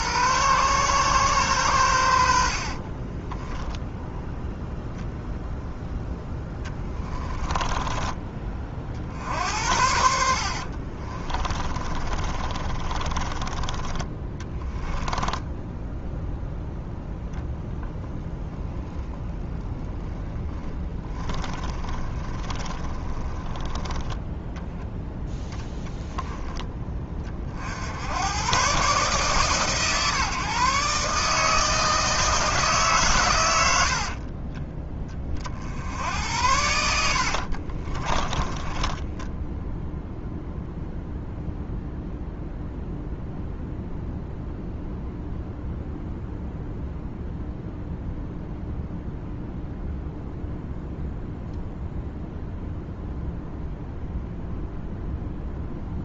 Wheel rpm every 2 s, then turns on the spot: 130, 30, 0, 20, 40, 40, 30, 10, 0, 10, 20, 20, 10, 20, 130, 150, 130, 20, 80, 10, 0, 0, 0, 0, 0, 0, 0, 0.
2-4 6-8 10-16 18-24 36-40